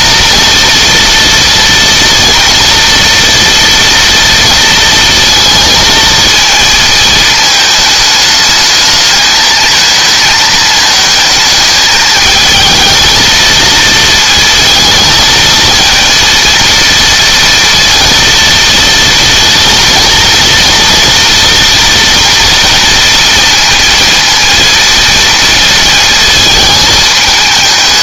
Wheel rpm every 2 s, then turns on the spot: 240, 230, 230, 220, 220, 220, 230, 220, 230, 230, 230, 230, 230, 220.
none